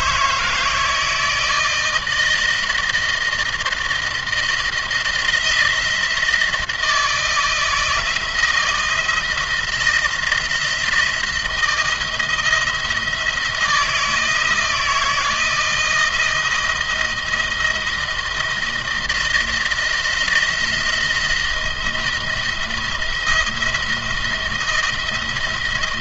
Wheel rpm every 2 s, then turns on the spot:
160, 160, 170, 160, 160, 170, 170, 170, 170, 170, 170, 170, 170.
none